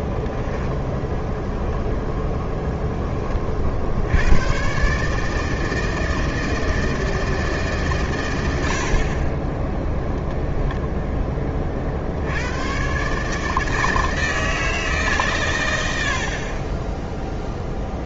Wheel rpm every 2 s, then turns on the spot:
10, 10, 130, 160, 60, 0, 130, 150, 20.
none